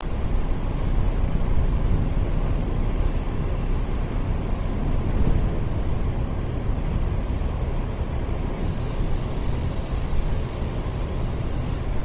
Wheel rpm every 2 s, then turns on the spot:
0, 0, 0, 0, 0, 0.
none